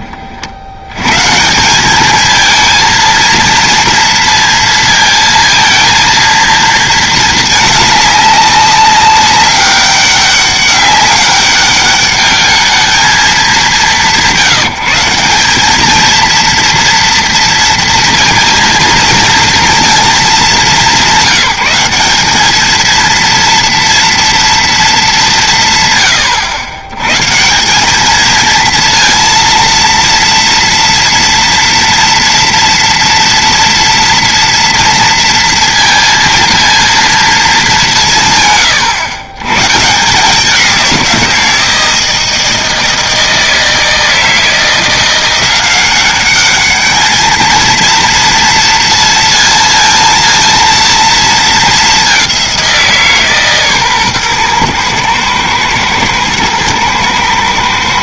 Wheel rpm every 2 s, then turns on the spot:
70, 220, 230, 220, 200, 200, 210, 170, 230, 230, 200, 220, 230, 100, 230, 230, 230, 230, 230, 130, 180, 160, 170, 210, 230, 230, 180, 120, 110.
none